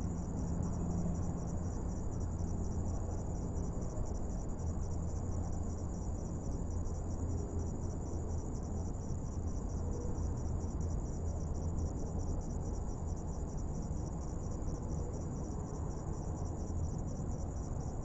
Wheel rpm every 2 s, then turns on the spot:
0, 0, 0, 0, 0, 0, 0, 0, 0.
none